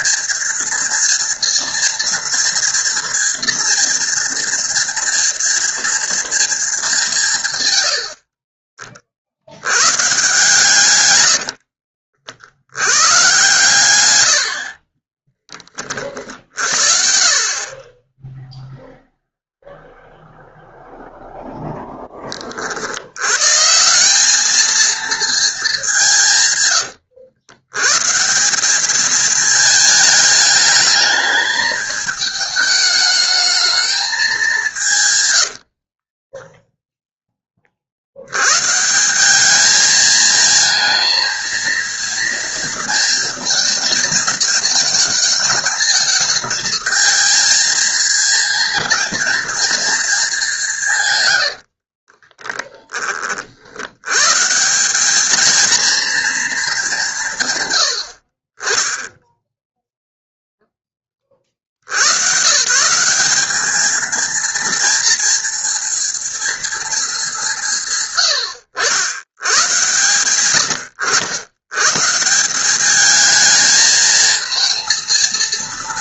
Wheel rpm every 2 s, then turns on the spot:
230, 230, 240, 190, 40, 130, 100, 40, 60, 0, 0, 40, 210, 130, 180, 210, 210, 190, 10, 90, 220, 230, 220, 220, 230, 210, 30, 130, 230, 40, 0, 100, 220, 230, 130, 120, 130, 220.
10-12 36-38 52-54